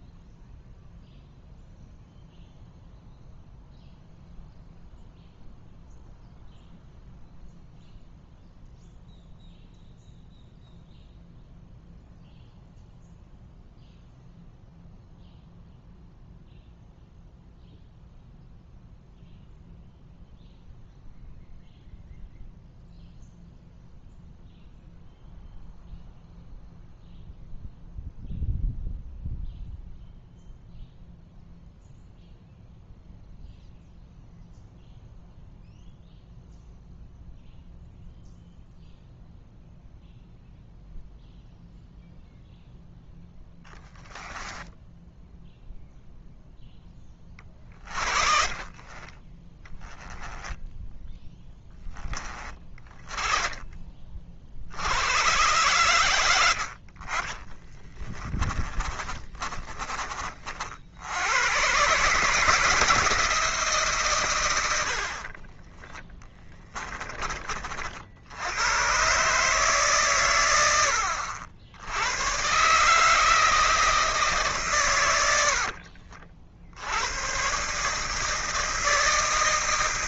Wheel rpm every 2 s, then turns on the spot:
0, 0, 0, 0, 0, 0, 0, 0, 0, 0, 0, 0, 0, 0, 0, 0, 0, 0, 0, 0, 0, 0, 10, 0, 30, 10, 30, 60, 70, 20, 50, 160, 90, 10, 110, 90, 130, 140, 70, 160.
48-50 52-54 56-60 66-68